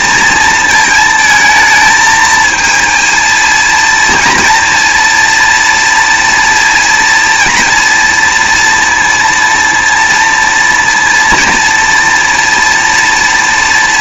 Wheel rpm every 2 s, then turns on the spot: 230, 230, 230, 230, 230, 230, 230.
none